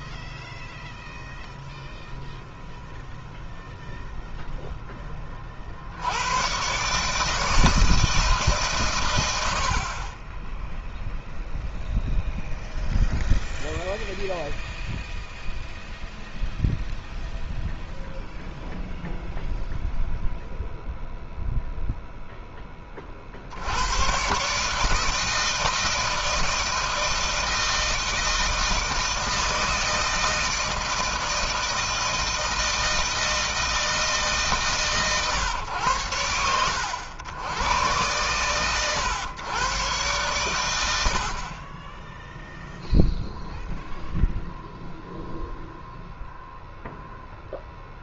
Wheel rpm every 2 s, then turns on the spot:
0, 0, 0, 120, 140, 10, 0, 0, 0, 0, 0, 10, 140, 160, 160, 160, 160, 150, 100, 130, 110, 0, 0, 0.
none